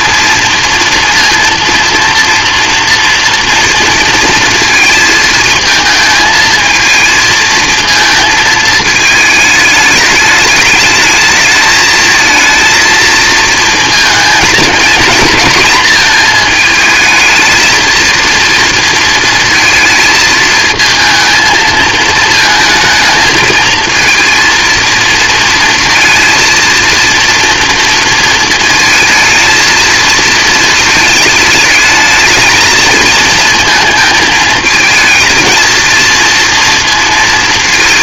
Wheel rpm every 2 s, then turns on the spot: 230, 230, 230, 220, 220, 210, 230, 230, 220, 230, 220, 220, 230, 230, 220, 220, 220, 220, 230.
none